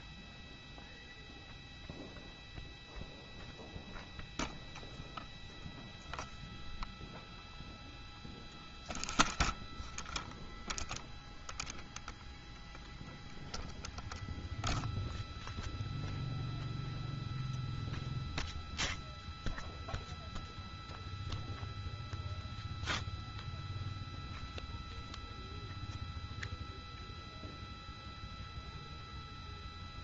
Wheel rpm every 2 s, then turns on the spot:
0, 0, 0, 0, 0, 0, 0, 0, 0, 0, 0, 0, 0, 0, 0.
none